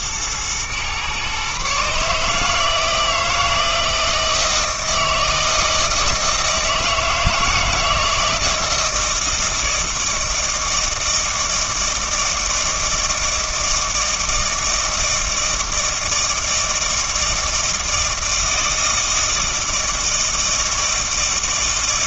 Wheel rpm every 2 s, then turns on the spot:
120, 160, 160, 160, 160, 160, 160, 160, 160, 160, 160.
none